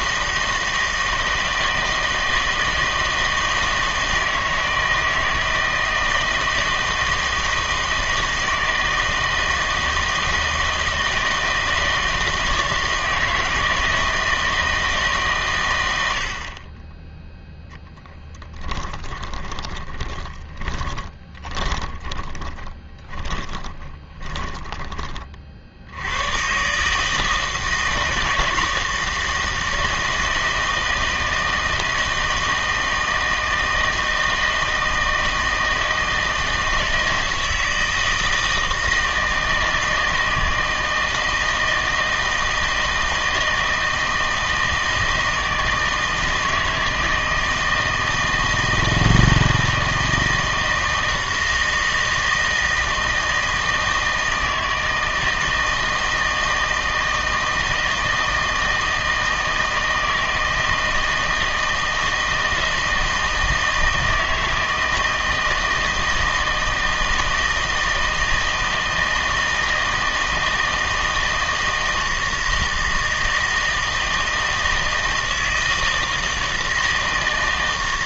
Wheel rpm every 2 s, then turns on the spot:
160, 160, 160, 160, 160, 160, 160, 160, 40, 10, 20, 20, 20, 130, 160, 160, 160, 160, 160, 160, 160, 160, 160, 160, 160, 160, 160, 160, 160, 160, 160, 160, 160, 160, 160, 160, 160, 160, 160.
18-26